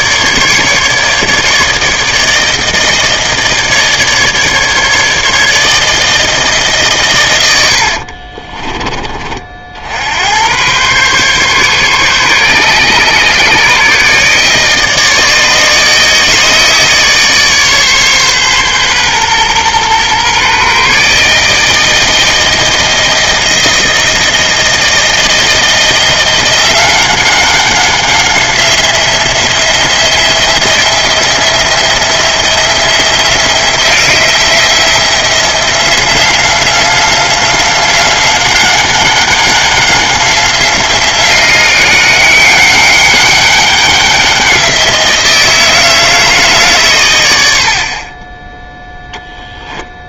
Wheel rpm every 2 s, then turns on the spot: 150, 160, 150, 150, 30, 100, 140, 150, 150, 130, 140, 160, 160, 180, 180, 170, 170, 170, 180, 190, 180, 190, 180, 150, 10.
8-10 48-50